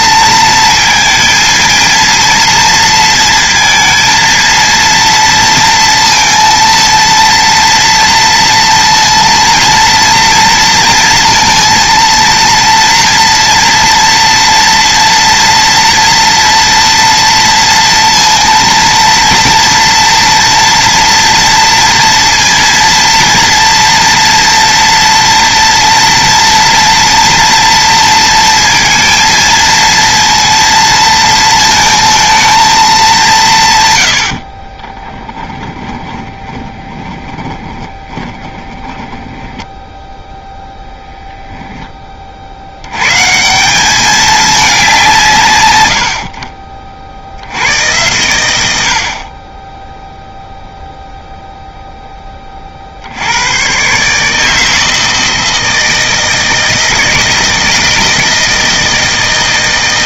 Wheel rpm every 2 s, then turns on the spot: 230, 230, 230, 230, 230, 230, 230, 240, 240, 230, 230, 230, 230, 230, 230, 230, 210, 30, 20, 10, 0, 100, 180, 40, 70, 0, 60, 160, 160, 160.
34-40